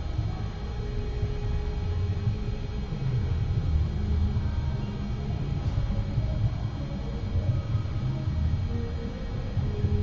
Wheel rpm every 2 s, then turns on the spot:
0, 0, 0, 0, 0.
none